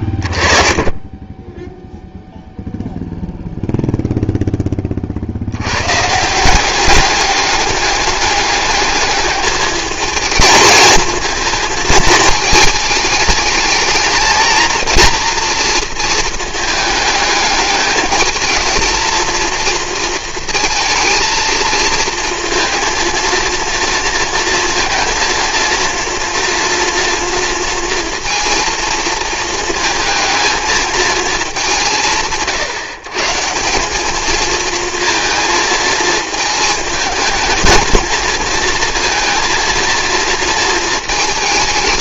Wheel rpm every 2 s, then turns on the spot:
20, 0, 20, 180, 210, 220, 220, 220, 220, 220, 230, 230, 230, 230, 230, 220, 140, 220, 210, 220, 230.
none